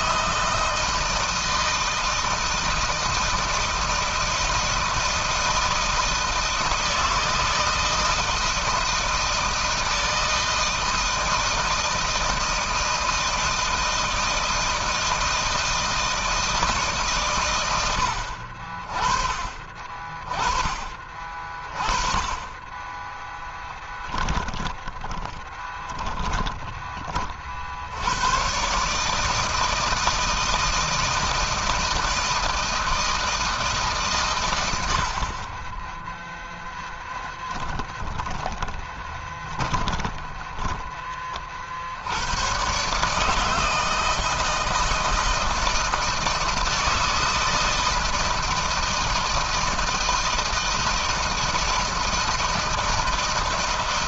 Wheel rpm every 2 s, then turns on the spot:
160, 160, 160, 160, 160, 160, 160, 160, 130, 30, 30, 10, 20, 40, 150, 160, 160, 50, 20, 30, 40, 150, 160, 160, 160, 160, 160.
22-26 36-40